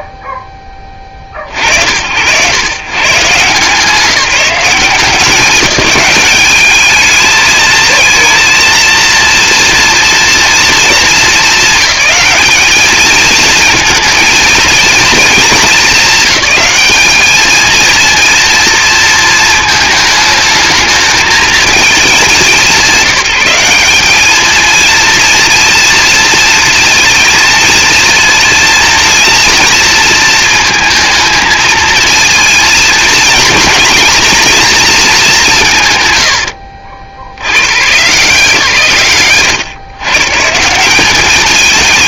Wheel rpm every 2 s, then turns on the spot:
10, 120, 180, 210, 230, 230, 210, 230, 210, 230, 220, 190, 230, 230, 230, 230, 230, 210, 30, 150, 170.
none